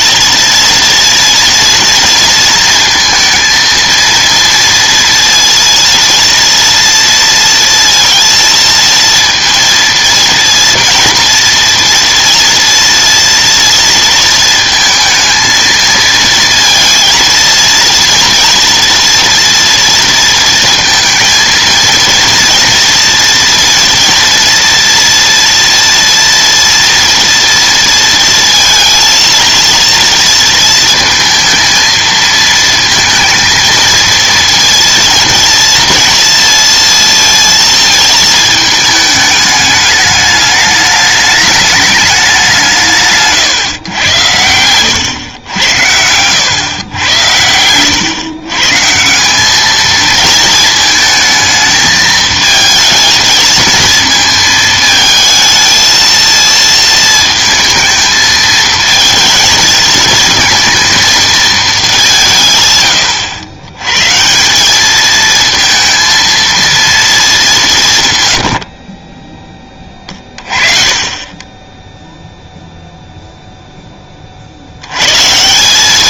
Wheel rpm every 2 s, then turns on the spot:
230, 230, 230, 230, 230, 230, 230, 220, 230, 230, 230, 230, 240, 230, 230, 230, 230, 230, 230, 220, 210, 190, 110, 110, 140, 220, 220, 220, 230, 220, 230, 130, 180, 230, 90, 30, 0, 70.
none